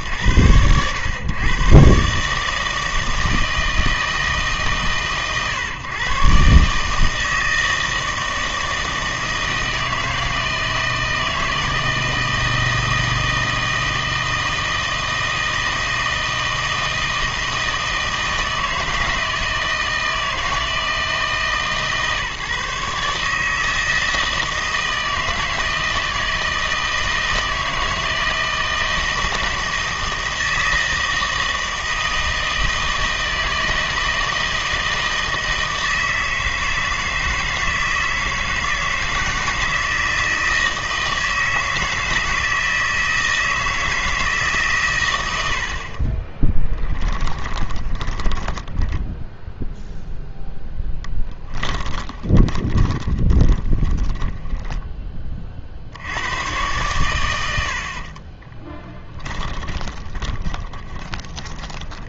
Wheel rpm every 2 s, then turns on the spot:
110, 160, 130, 140, 160, 160, 160, 160, 160, 160, 160, 150, 160, 160, 160, 160, 160, 160, 160, 160, 160, 160, 140, 20, 10, 0, 20, 10, 110, 10, 20.
46-50 52-54 58-62